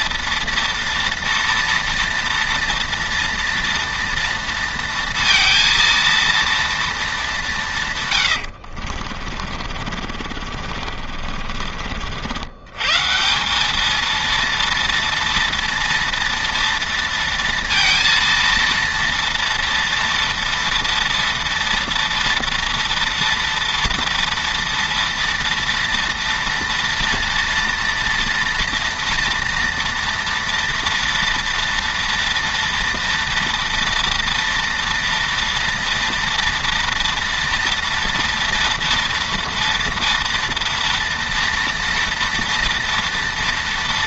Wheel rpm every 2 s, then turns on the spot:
230, 230, 230, 210, 50, 50, 170, 230, 230, 230, 230, 230, 230, 230, 230, 230, 230, 230, 230, 230, 230, 230.
8-12